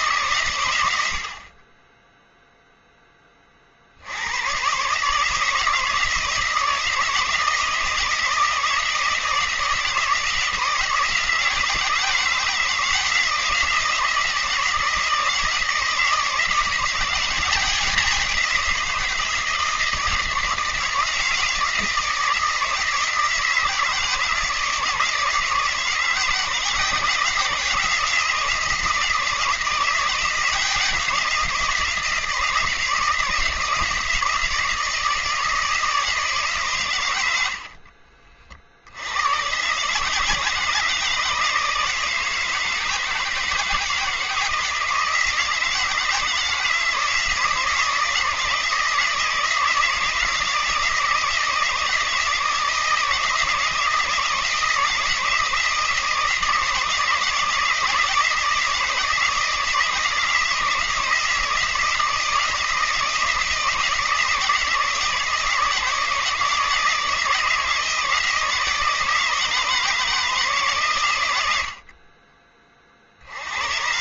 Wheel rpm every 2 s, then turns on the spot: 100, 0, 130, 160, 160, 160, 170, 170, 170, 180, 170, 160, 150, 170, 170, 180, 160, 170, 130, 60, 160, 160, 160, 160, 160, 160, 160, 160, 160, 160, 160, 160, 160, 160, 160, 150, 30.
none